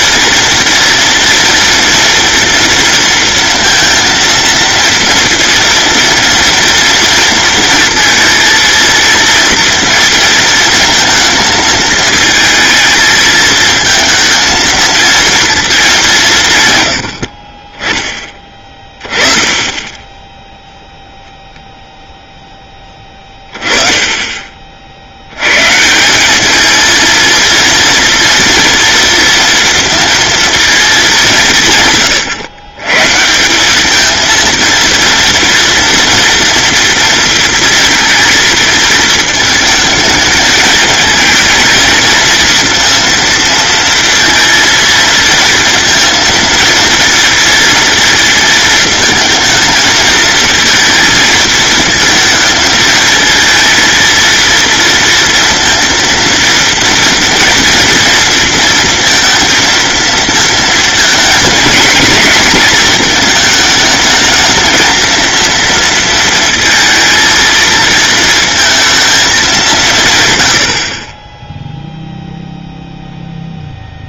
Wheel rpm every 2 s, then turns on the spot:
230, 230, 230, 230, 230, 230, 220, 230, 100, 20, 0, 10, 40, 230, 230, 230, 130, 230, 230, 220, 220, 230, 230, 220, 220, 230, 230, 230, 230, 230, 230, 230, 220, 230, 230, 70, 0.
22-24